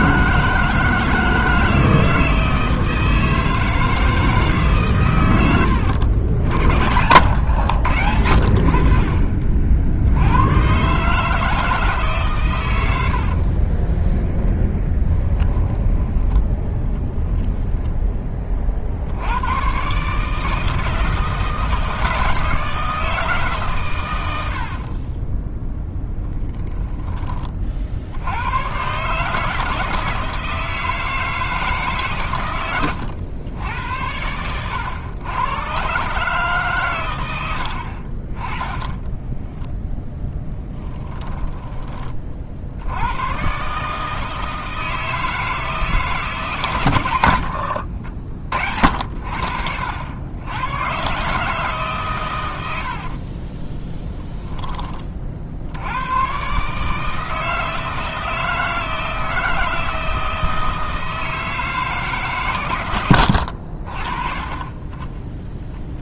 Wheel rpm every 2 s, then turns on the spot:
160, 160, 130, 70, 60, 130, 90, 20, 20, 60, 160, 160, 50, 10, 130, 160, 100, 100, 130, 20, 10, 80, 160, 120, 60, 120, 70, 30, 150, 160, 160, 120, 20.
6-8 14-16 24-28 38-42 52-54